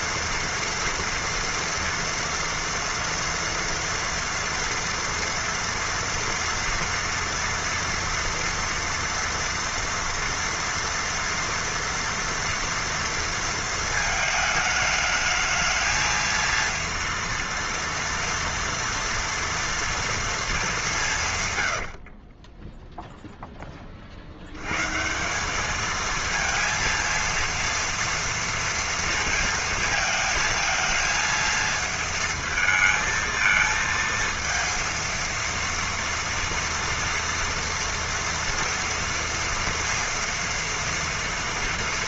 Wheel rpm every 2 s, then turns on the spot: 230, 230, 230, 230, 230, 230, 230, 220, 230, 230, 210, 10, 110, 230, 230, 220, 220, 230, 230, 230, 230.
22-24